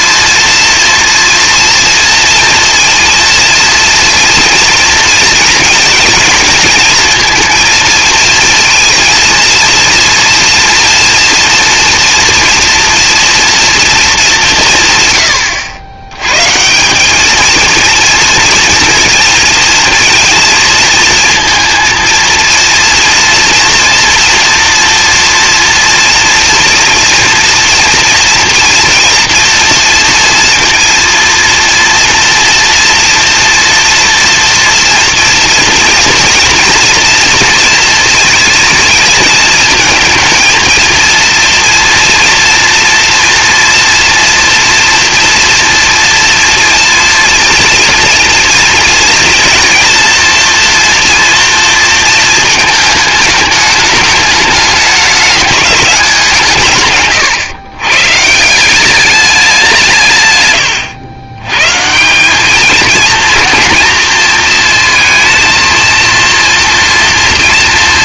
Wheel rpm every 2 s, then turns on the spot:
230, 230, 230, 220, 230, 230, 230, 170, 160, 230, 230, 230, 230, 230, 240, 230, 230, 230, 230, 220, 230, 230, 230, 230, 230, 230, 220, 210, 140, 180, 110, 220, 230, 230.
none